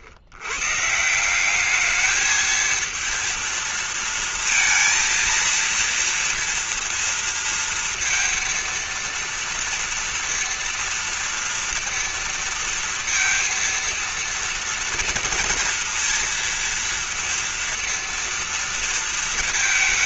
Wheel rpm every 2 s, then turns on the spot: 90, 220, 230, 230, 230, 230, 230, 230, 230, 230.
none